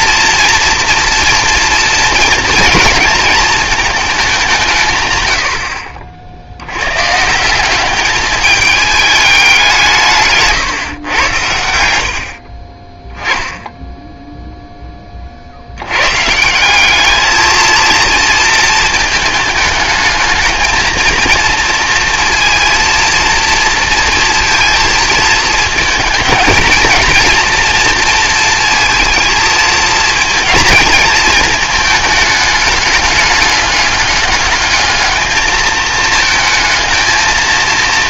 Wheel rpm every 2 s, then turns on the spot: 230, 230, 150, 100, 210, 130, 30, 0, 180, 220, 220, 230, 220, 220, 230, 220, 210, 210, 230.
none